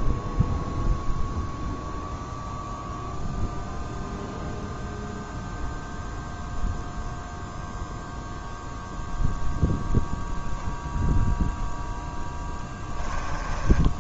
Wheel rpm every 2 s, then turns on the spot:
0, 0, 0, 0, 0, 0, 20.
12-14